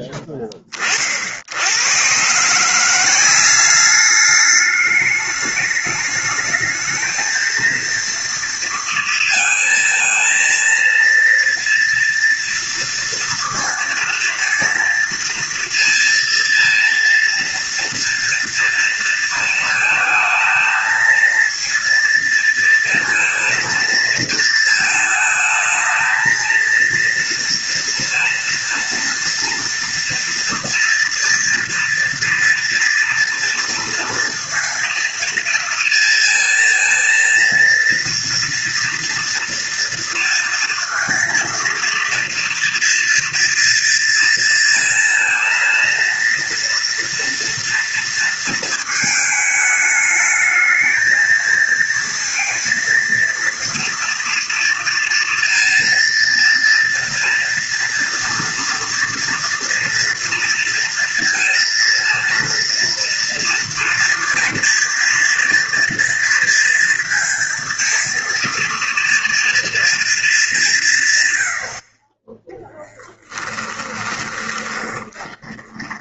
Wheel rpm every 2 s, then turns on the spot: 30, 180, 210, 220, 230, 230, 230, 230, 230, 230, 220, 230, 220, 230, 230, 230, 240, 230, 230, 230, 230, 230, 230, 230, 220, 220, 230, 230, 230, 230, 230, 230, 230, 230, 230, 160, 10, 20.
72-76